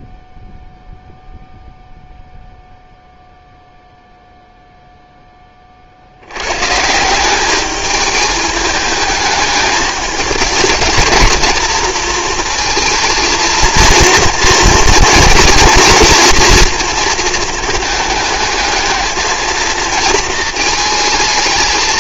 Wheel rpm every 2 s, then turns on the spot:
0, 0, 0, 130, 210, 220, 230, 230, 230, 220, 220.
none